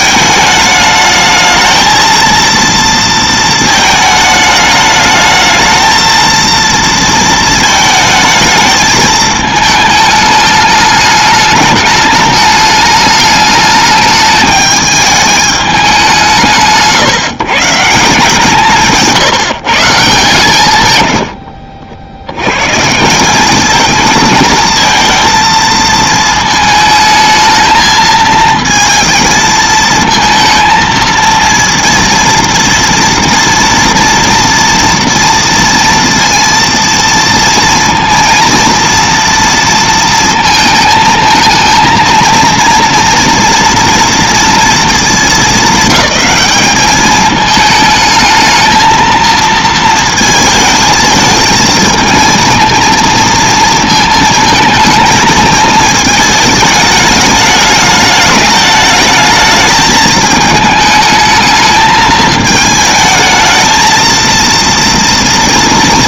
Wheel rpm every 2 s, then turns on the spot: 220, 230, 210, 230, 220, 210, 210, 210, 150, 170, 140, 130, 220, 220, 230, 230, 230, 230, 230, 230, 220, 230, 230, 200, 220, 220, 230, 230, 210, 210, 220, 220, 230.
none